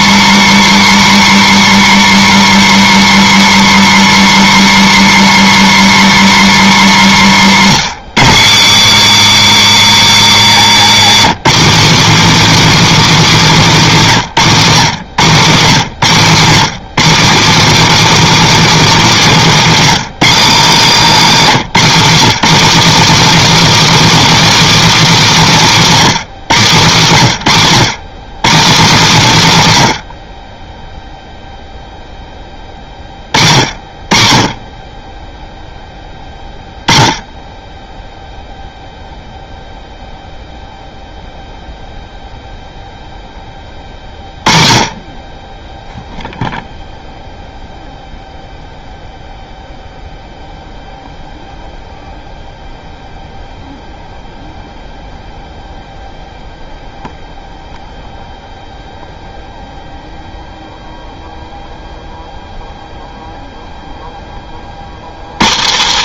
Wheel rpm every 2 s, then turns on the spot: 310, 310, 310, 280, 280, 260, 320, 180, 220, 300, 260, 290, 320, 180, 210, 10, 20, 30, 20, 0, 0, 0, 30, 0, 0, 0, 0, 0, 0, 0, 0, 0, 80.
none